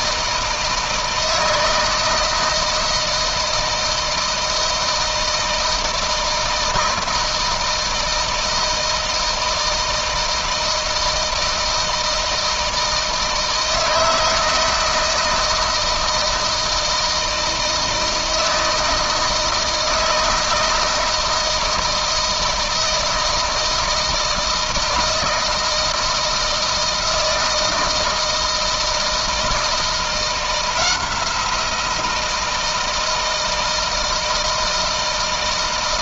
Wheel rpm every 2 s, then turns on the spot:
160, 160, 160, 160, 160, 160, 160, 160, 160, 160, 160, 160, 160, 160, 160, 170, 160, 160.
none